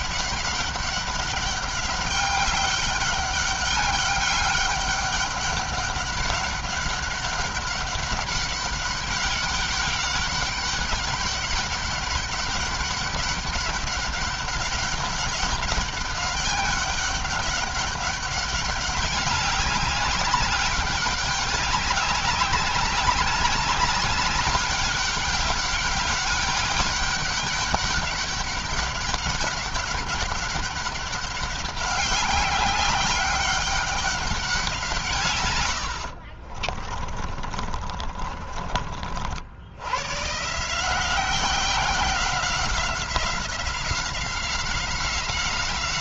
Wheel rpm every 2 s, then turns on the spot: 200, 200, 200, 200, 190, 200, 200, 190, 200, 200, 190, 200, 200, 200, 200, 200, 190, 180, 40, 40, 160, 180, 180.
36-38